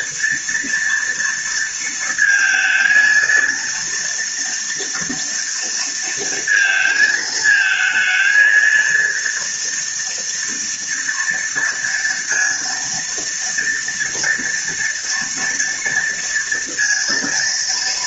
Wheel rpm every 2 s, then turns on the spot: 230, 230, 230, 220, 230, 230, 230, 230, 240.
none